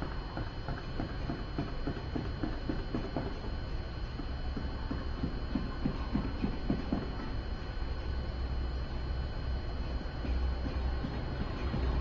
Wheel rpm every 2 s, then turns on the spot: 0, 0, 0, 0, 0, 0.
none